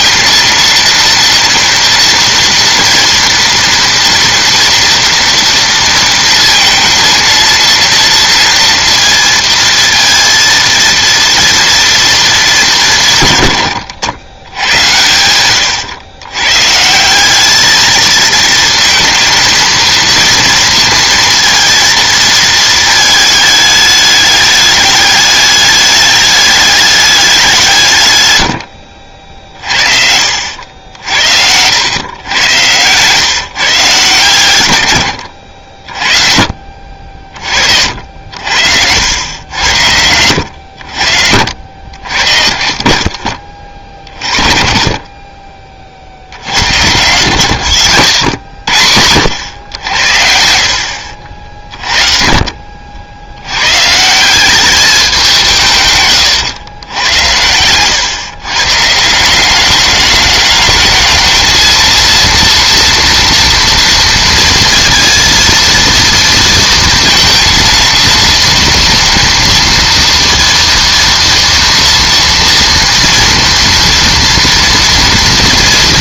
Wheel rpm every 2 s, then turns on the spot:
230, 230, 230, 230, 230, 230, 180, 90, 140, 220, 230, 220, 210, 210, 60, 70, 110, 100, 40, 80, 70, 40, 40, 100, 80, 60, 40, 190, 110, 140, 210, 230, 230, 230, 230, 230, 230, 230.
none